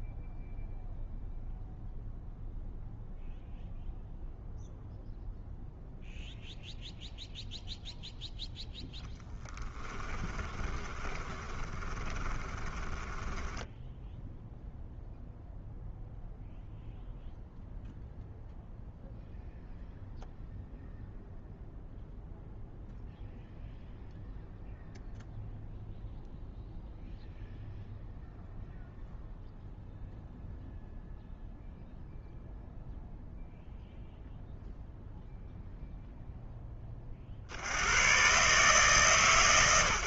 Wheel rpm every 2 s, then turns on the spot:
0, 0, 0, 0, 0, 20, 20, 0, 0, 0, 0, 0, 0, 0, 0, 0, 0, 0, 10, 140.
10-14